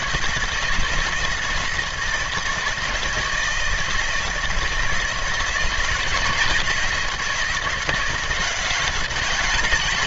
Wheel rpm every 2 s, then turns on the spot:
160, 160, 160, 160, 180.
none